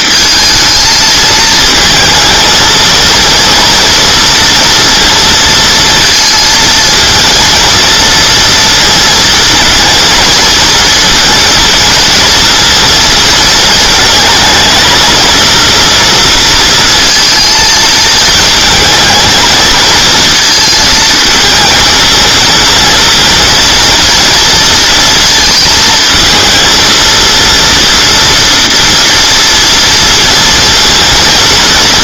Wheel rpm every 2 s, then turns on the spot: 220, 230, 230, 230, 230, 230, 230, 220, 230, 220, 220, 230, 230, 220, 230, 230.
none